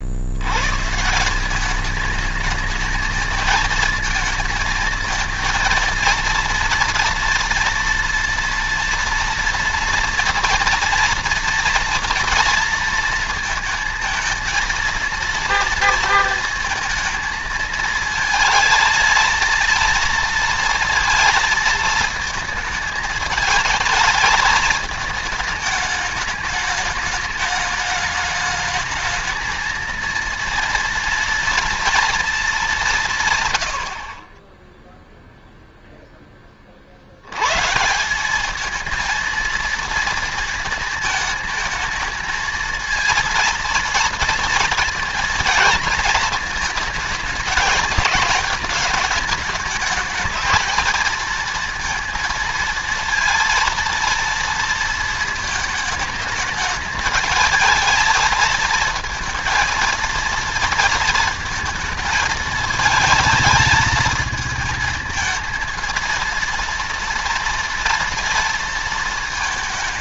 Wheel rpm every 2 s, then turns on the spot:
150, 220, 230, 230, 230, 230, 230, 230, 220, 230, 230, 220, 220, 210, 220, 230, 180, 10, 50, 220, 220, 230, 220, 220, 220, 220, 230, 230, 220, 230, 230, 220, 220, 230, 230.
none